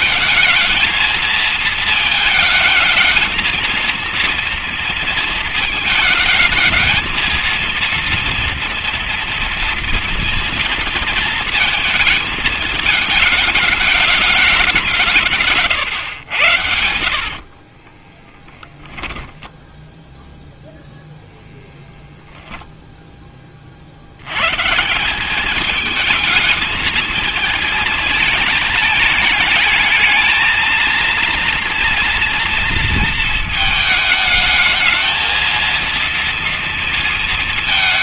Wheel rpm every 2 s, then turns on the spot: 220, 220, 230, 220, 230, 230, 220, 200, 110, 20, 0, 0, 130, 220, 220, 230, 230, 220, 230.
18-20